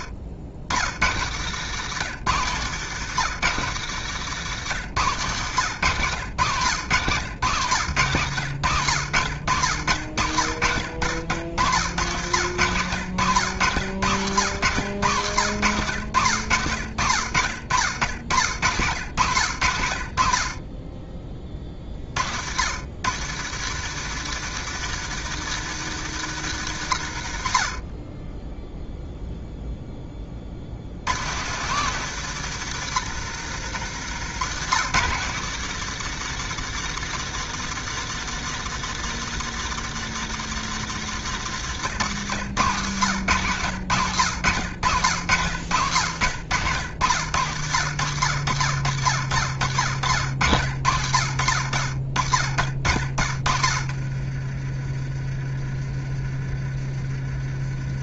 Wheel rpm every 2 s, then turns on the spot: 70, 150, 130, 120, 90, 60, 110, 110, 70, 80, 30, 110, 160, 100, 0, 90, 140, 140, 160, 160, 150, 120, 90, 90, 60, 60, 30, 30, 30.
none